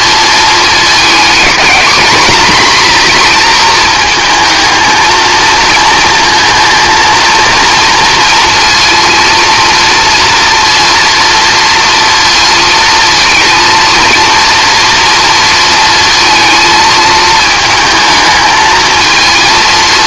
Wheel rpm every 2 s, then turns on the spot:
220, 230, 230, 230, 230, 230, 230, 230, 220, 220.
none